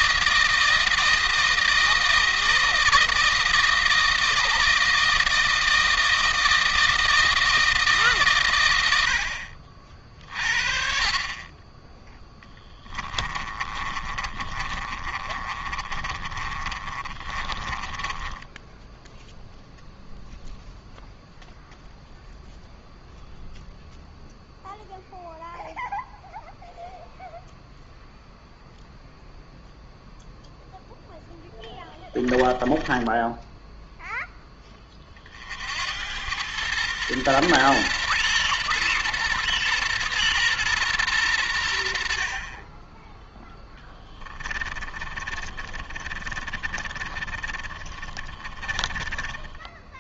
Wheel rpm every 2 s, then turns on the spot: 160, 160, 160, 160, 100, 50, 10, 30, 40, 10, 0, 0, 0, 0, 0, 0, 20, 20, 110, 120, 110, 20, 30, 30, 30.
12-20 32-34 44-50